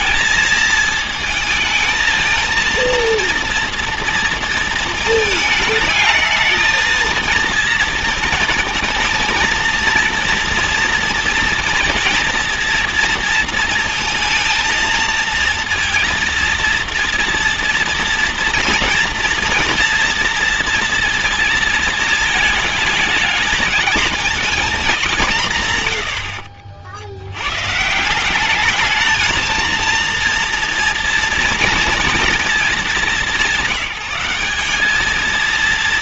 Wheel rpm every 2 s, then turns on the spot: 220, 230, 230, 220, 230, 230, 230, 230, 230, 230, 240, 220, 220, 60, 200, 230, 220, 200.
none